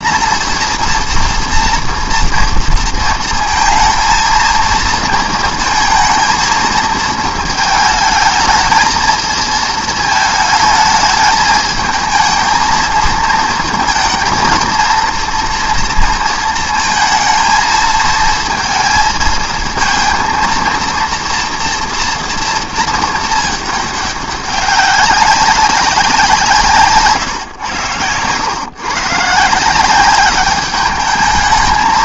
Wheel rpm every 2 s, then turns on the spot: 230, 230, 230, 230, 220, 220, 220, 230, 230, 230, 230, 230, 200, 160, 130, 210.
none